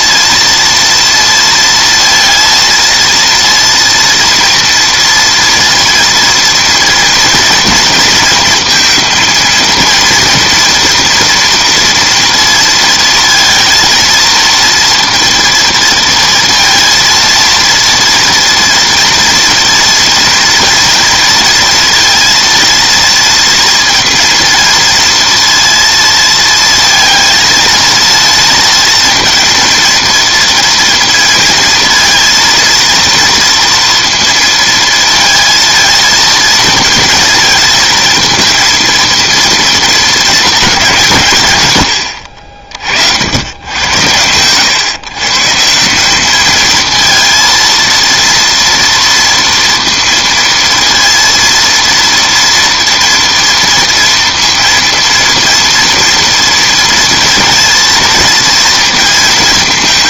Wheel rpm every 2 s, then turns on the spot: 230, 230, 230, 230, 230, 240, 230, 230, 230, 230, 240, 230, 230, 230, 230, 230, 230, 230, 230, 230, 210, 60, 110, 220, 230, 230, 230, 230, 230, 230.
none